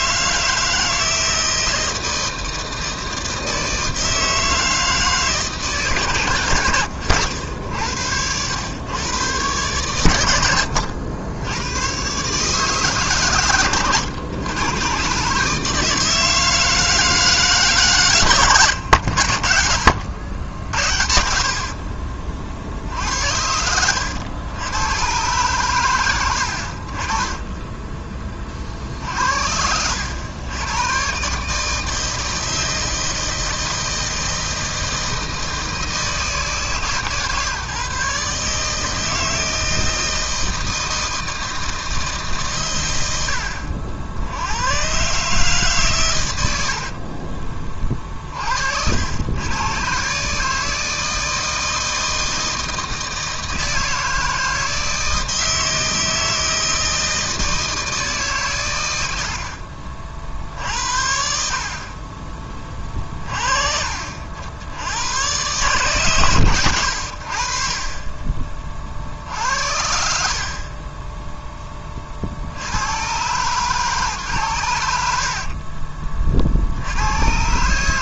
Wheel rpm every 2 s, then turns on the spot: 160, 160, 160, 90, 110, 80, 150, 120, 160, 90, 70, 60, 90, 50, 50, 120, 160, 160, 140, 160, 160, 90, 130, 50, 80, 160, 160, 160, 160, 90, 60, 30, 90, 80, 50, 20, 110, 80, 80.
42-44 46-48